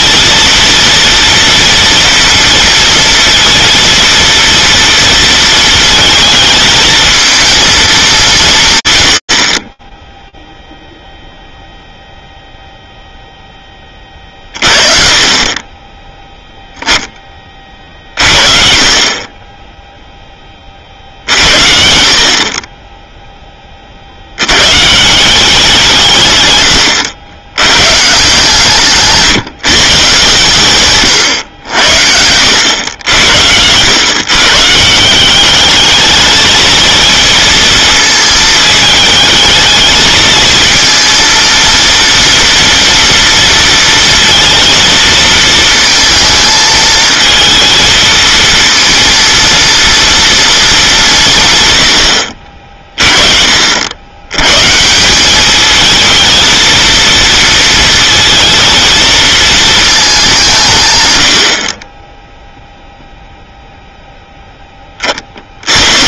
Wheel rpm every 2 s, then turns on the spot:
230, 230, 230, 220, 150, 0, 0, 40, 10, 40, 50, 0, 170, 90, 150, 120, 90, 170, 230, 220, 230, 230, 230, 220, 230, 190, 30, 170, 230, 220, 120, 0, 20.
none